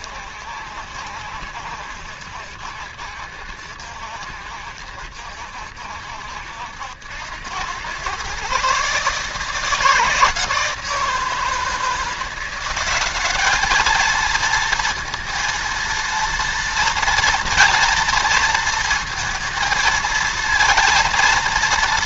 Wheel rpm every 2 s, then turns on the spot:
60, 70, 70, 70, 140, 160, 180, 230, 230, 230, 230.
none